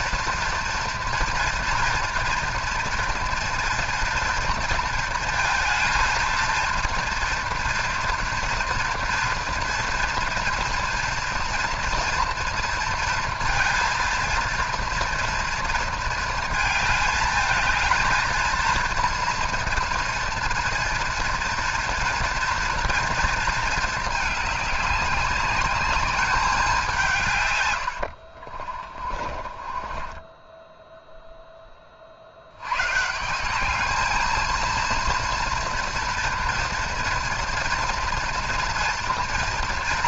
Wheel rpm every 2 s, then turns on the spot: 230, 230, 230, 230, 230, 230, 230, 230, 220, 230, 230, 230, 210, 200, 50, 10, 120, 230, 230, 230.
28-32